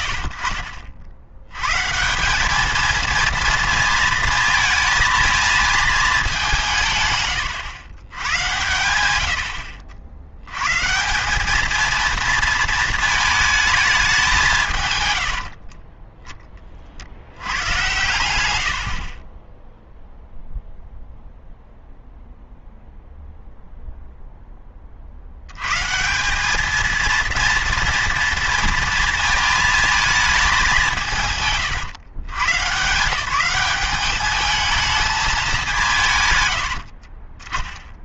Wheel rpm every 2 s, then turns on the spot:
50, 220, 230, 160, 100, 140, 230, 150, 30, 80, 0, 0, 20, 220, 230, 190, 140, 220, 90.
none